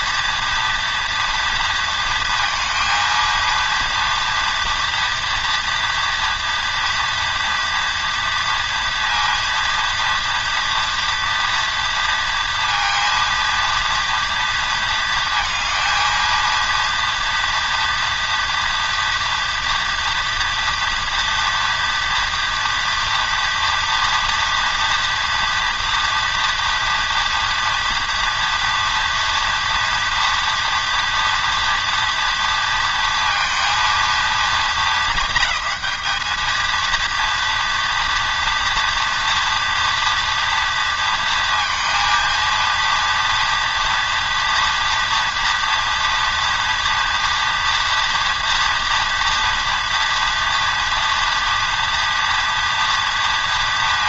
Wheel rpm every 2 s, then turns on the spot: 230, 230, 230, 230, 230, 230, 230, 230, 230, 230, 240, 230, 240, 230, 230, 240, 230, 210, 210, 230, 230, 230, 230, 230, 230, 230, 230.
none